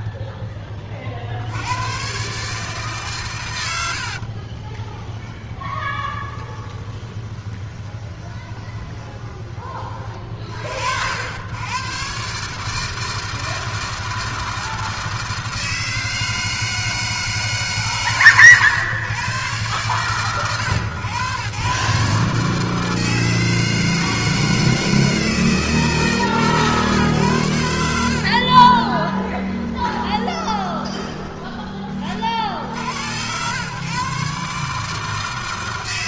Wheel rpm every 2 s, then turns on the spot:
100, 100, 20, 20, 20, 70, 160, 160, 150, 110, 110, 160, 160, 110, 20, 20, 100, 150.
2-10 28-32